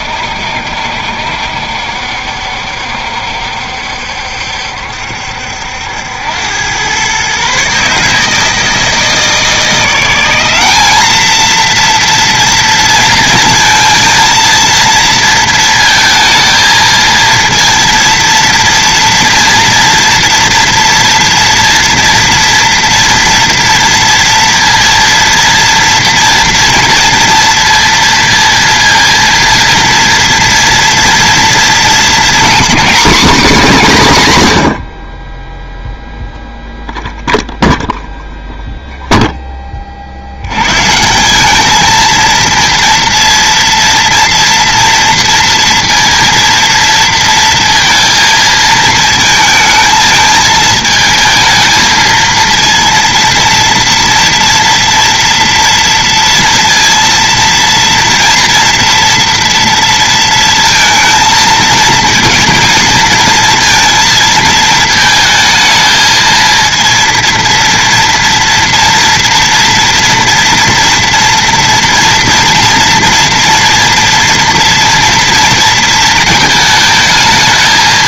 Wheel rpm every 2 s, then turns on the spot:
70, 70, 70, 110, 160, 210, 230, 230, 230, 230, 230, 230, 230, 230, 230, 240, 240, 70, 0, 0, 140, 230, 230, 230, 220, 220, 230, 230, 230, 230, 230, 230, 220, 230, 230, 230, 230, 230, 220.
none